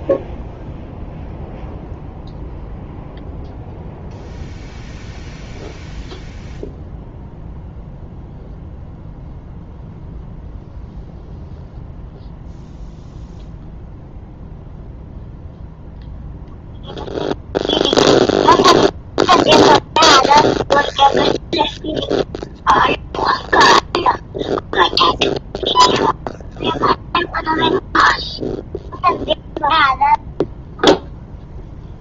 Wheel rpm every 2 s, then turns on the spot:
0, 0, 0, 0, 0, 0, 0, 0, 0, 0, 0, 0, 0, 0, 0, 0.
none